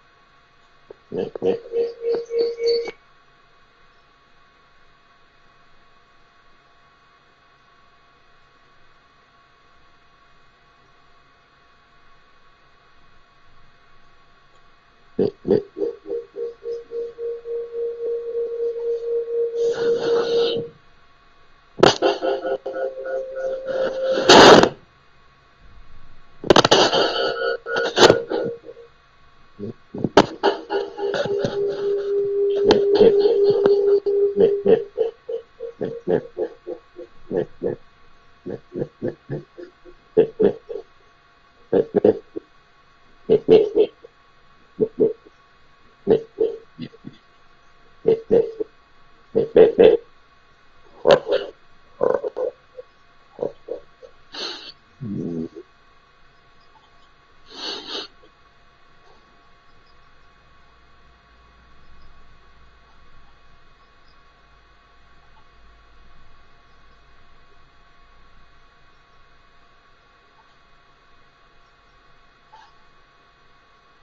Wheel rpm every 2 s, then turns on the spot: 0, 0, 0, 0, 0, 0, 0, 0, 0, 0, 0, 0, 0, 0, 0, 0, 0, 0, 0, 0, 0, 0, 0, 0, 0, 0, 0, 0, 0, 0, 0, 0, 0, 0, 0, 0, 0.
none